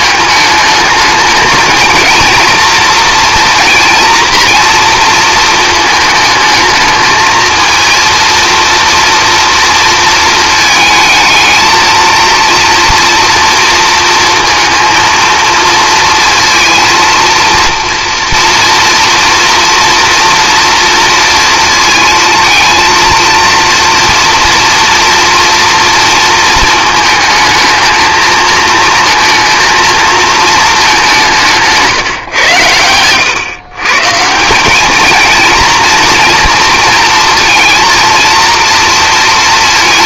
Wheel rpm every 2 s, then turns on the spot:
210, 230, 230, 220, 230, 220, 230, 230, 230, 230, 230, 230, 230, 220, 220, 200, 100, 210, 230, 230.
32-34